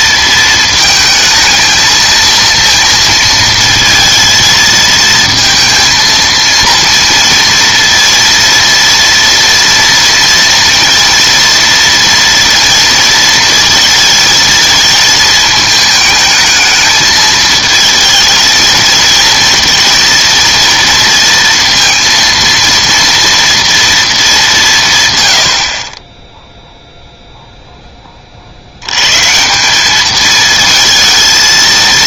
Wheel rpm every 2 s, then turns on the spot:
220, 230, 220, 230, 230, 230, 230, 220, 220, 230, 230, 230, 130, 0, 110, 220.
none